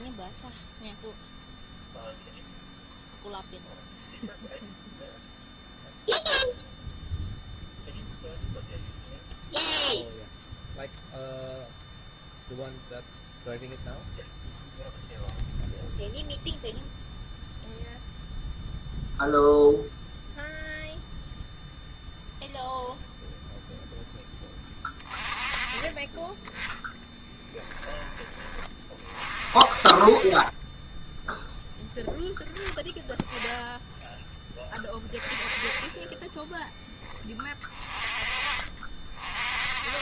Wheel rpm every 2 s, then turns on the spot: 10, 0, 0, 0, 0, 0, 0, 0, 0, 0, 0, 0, 20, 10, 30, 10, 10, 10, 10, 40.
26-28